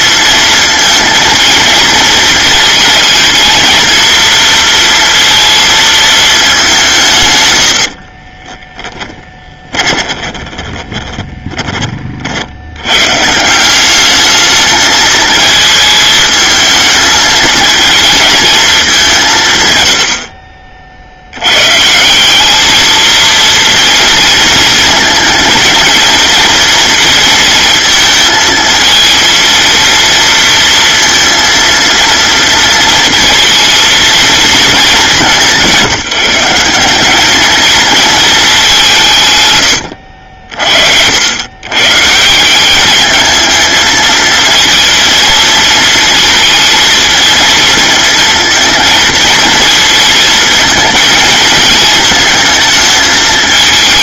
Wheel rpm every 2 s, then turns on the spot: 220, 230, 230, 140, 10, 30, 130, 220, 220, 180, 60, 220, 230, 230, 230, 230, 230, 200, 180, 170, 70, 210, 230, 220, 220, 220, 220.
8-12